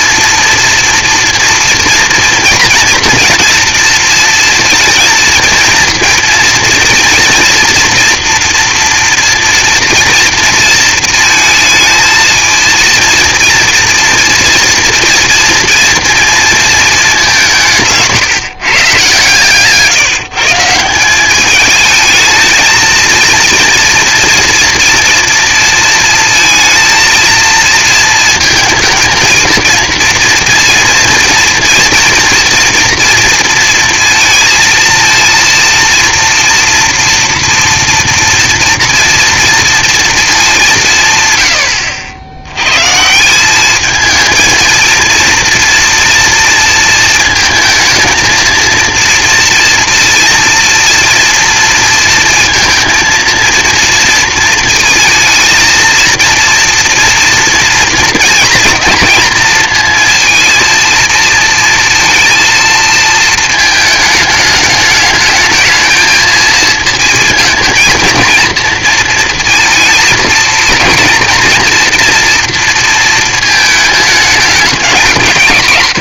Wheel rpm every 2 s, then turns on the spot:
230, 240, 230, 230, 230, 230, 230, 240, 220, 140, 170, 230, 240, 230, 230, 230, 240, 230, 240, 230, 190, 110, 230, 230, 230, 230, 230, 220, 240, 230, 230, 230, 210, 230, 230, 230, 230, 200.
none